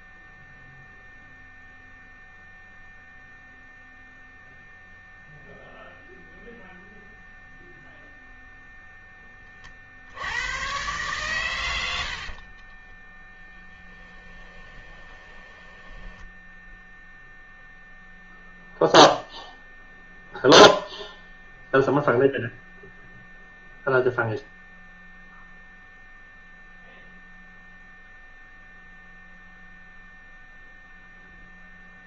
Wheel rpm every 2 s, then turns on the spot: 0, 0, 0, 0, 0, 110, 30, 20, 0, 0, 0, 0, 0, 0, 0, 0.
12-16